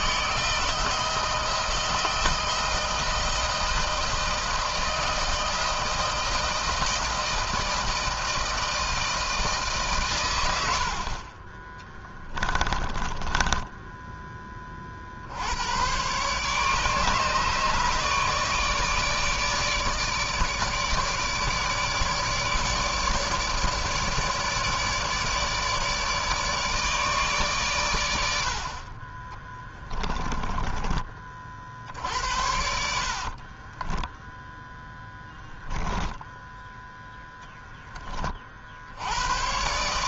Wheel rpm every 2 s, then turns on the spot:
160, 160, 160, 160, 160, 100, 20, 20, 140, 150, 160, 150, 150, 150, 80, 20, 70, 10, 10, 50.
12-14 30-38